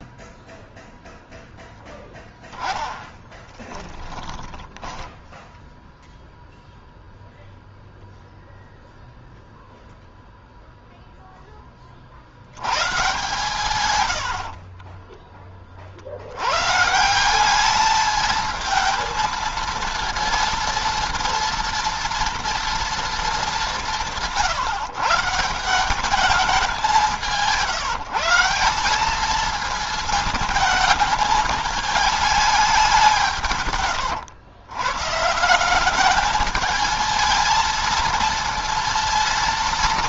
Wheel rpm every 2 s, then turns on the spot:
0, 10, 10, 0, 0, 0, 120, 30, 140, 220, 230, 230, 140, 190, 190, 220, 200, 120, 220, 230.
2-6 14-16